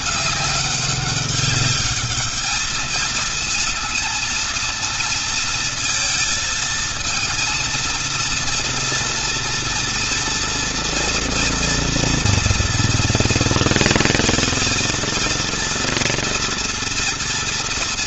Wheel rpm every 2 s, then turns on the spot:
200, 210, 220, 220, 230, 230, 230, 230, 230.
none